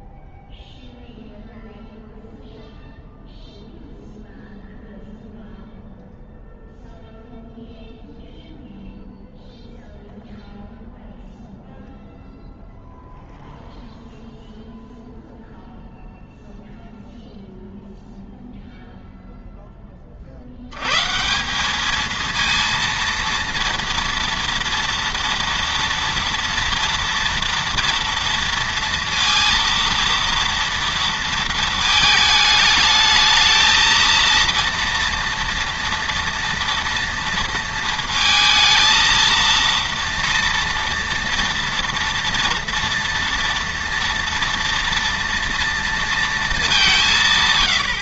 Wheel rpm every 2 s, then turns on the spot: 0, 0, 0, 0, 0, 0, 0, 0, 0, 0, 100, 230, 230, 230, 230, 230, 210, 230, 230, 230, 230, 230, 230, 210.
none